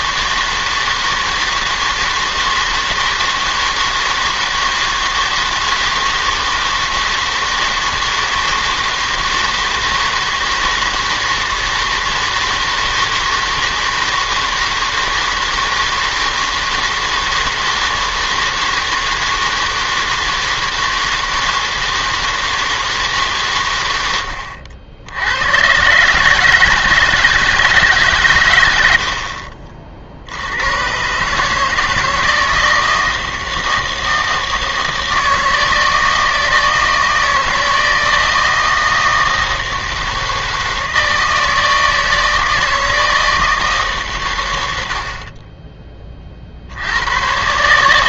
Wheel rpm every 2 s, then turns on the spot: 160, 160, 160, 160, 160, 160, 160, 160, 160, 160, 160, 160, 70, 150, 100, 100, 160, 160, 160, 160, 160, 160, 90, 70.
none